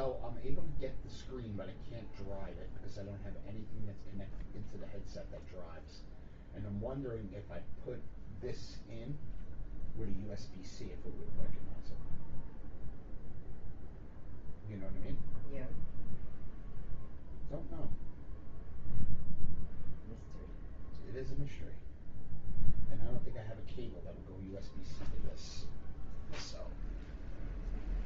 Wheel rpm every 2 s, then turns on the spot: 0, 0, 0, 0, 0, 0, 0, 0, 0, 0, 0, 0, 0, 0.
none